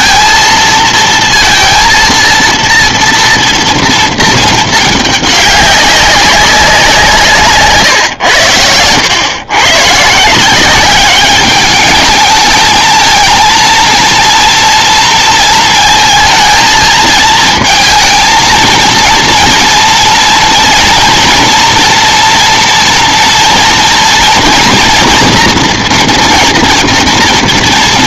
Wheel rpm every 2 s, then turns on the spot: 230, 230, 210, 150, 110, 210, 220, 230, 230, 230, 230, 240, 240, 230.
none